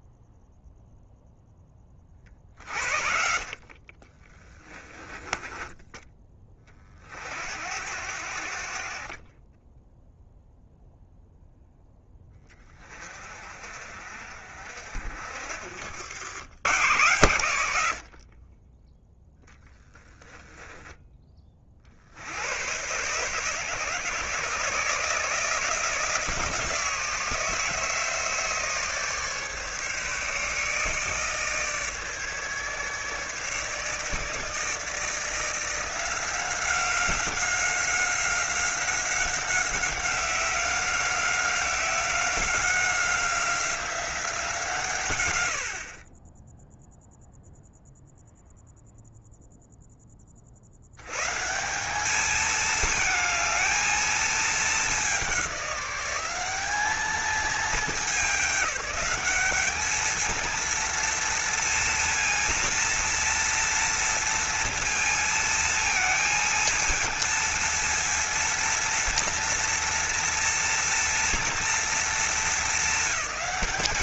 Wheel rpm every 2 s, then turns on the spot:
0, 50, 10, 40, 50, 0, 30, 50, 90, 20, 20, 120, 150, 160, 150, 150, 150, 160, 190, 190, 190, 190, 130, 0, 0, 100, 220, 210, 210, 200, 230, 230, 230, 220, 230, 230, 220.
4-6